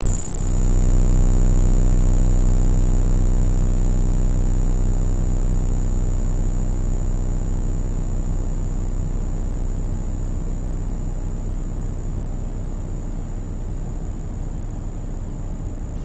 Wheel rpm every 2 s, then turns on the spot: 0, 0, 0, 0, 0, 0, 0, 0.
none